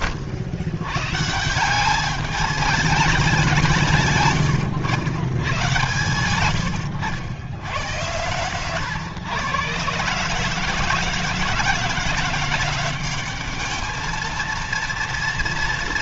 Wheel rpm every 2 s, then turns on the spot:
120, 210, 120, 100, 130, 160, 190, 230.
none